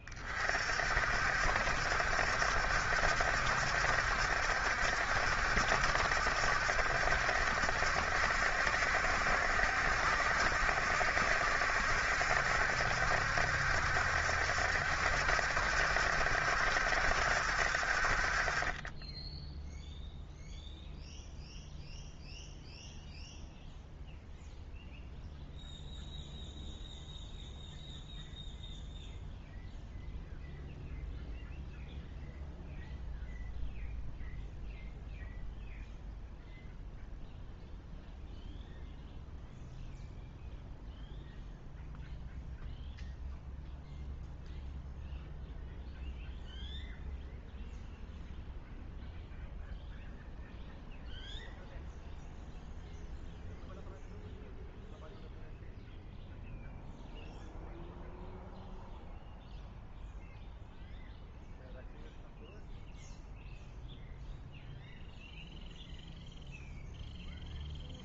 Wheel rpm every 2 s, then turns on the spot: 40, 70, 70, 70, 70, 70, 70, 70, 70, 30, 0, 0, 0, 0, 0, 0, 0, 0, 0, 0, 0, 0, 0, 0, 0, 0, 0, 0, 0, 0, 0, 0, 0, 0.
none